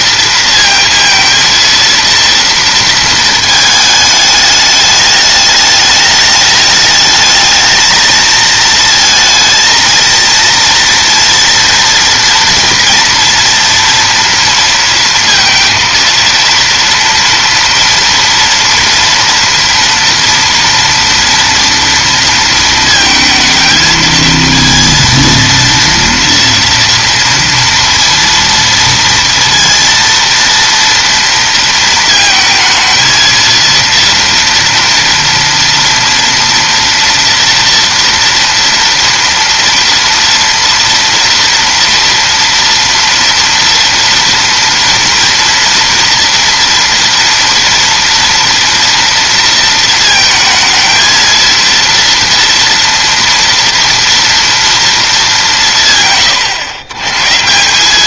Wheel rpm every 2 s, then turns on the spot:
230, 230, 210, 210, 220, 230, 230, 230, 230, 230, 230, 230, 230, 230, 230, 230, 220, 230, 240, 230, 230, 230, 230, 230, 230, 220, 230, 220, 120.
none